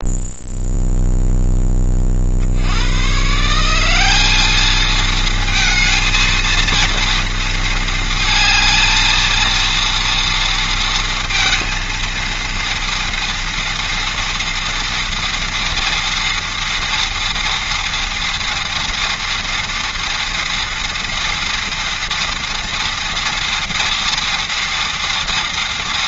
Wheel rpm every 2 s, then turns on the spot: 0, 130, 220, 230, 230, 230, 240, 230, 230, 230, 230, 230, 230.
none